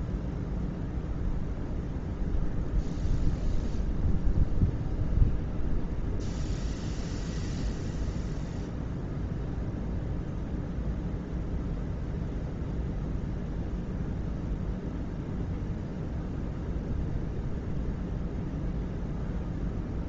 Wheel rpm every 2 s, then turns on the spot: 0, 0, 0, 0, 0, 0, 0, 0, 0, 0.
none